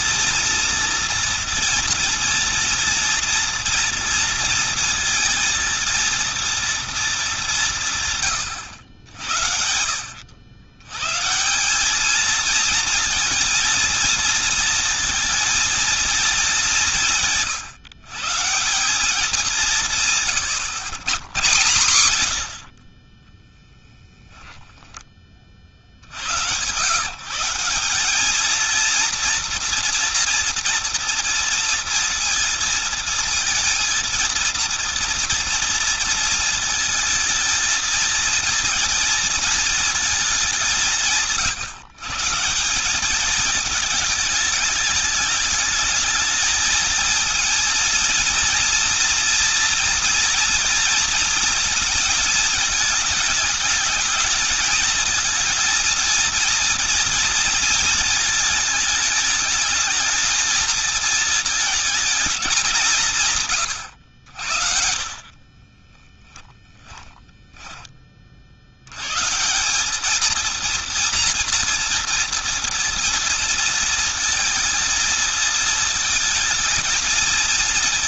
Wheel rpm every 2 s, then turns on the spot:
230, 230, 230, 230, 100, 110, 230, 230, 190, 170, 130, 60, 10, 130, 230, 230, 230, 230, 230, 220, 160, 180, 210, 220, 230, 230, 220, 220, 230, 210, 220, 170, 50, 10, 100, 230, 230, 220, 230.
64-68